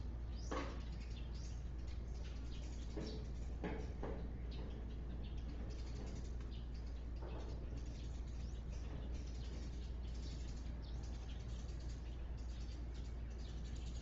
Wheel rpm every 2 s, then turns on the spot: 0, 0, 0, 0, 0, 0, 0.
none